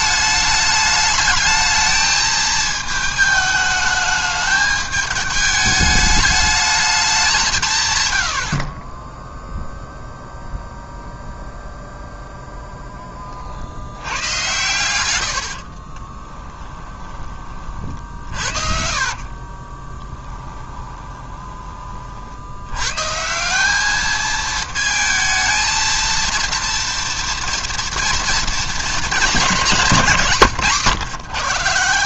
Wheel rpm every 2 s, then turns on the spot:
210, 220, 210, 210, 40, 0, 10, 100, 10, 60, 20, 100, 220, 230, 230, 140.
16-22